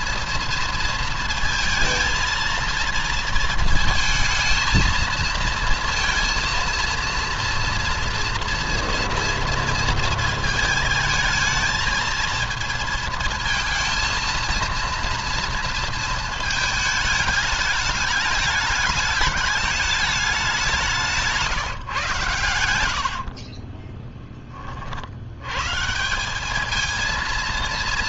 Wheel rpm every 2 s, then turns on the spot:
230, 230, 220, 230, 230, 220, 220, 230, 220, 210, 180, 80, 50, 220.
22-24